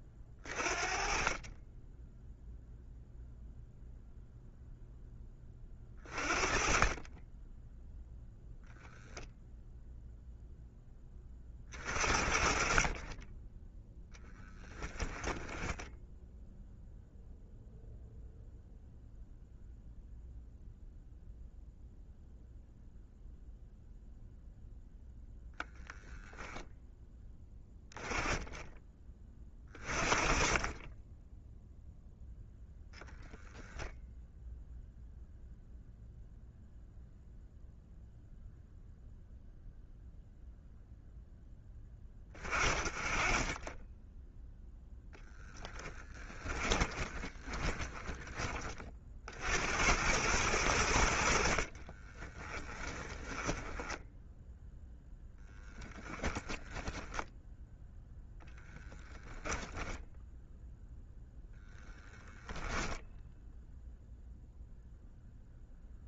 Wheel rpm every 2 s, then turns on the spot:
40, 0, 0, 20, 0, 10, 30, 10, 0, 0, 0, 0, 0, 10, 20, 20, 10, 0, 0, 0, 0, 20, 10, 20, 40, 80, 10, 0, 0, 10, 0, 0, 0.
14-16 46-48 52-54